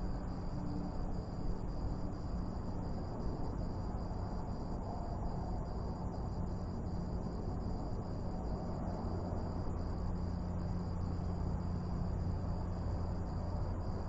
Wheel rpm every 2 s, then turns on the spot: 0, 0, 0, 0, 0, 0, 0.
none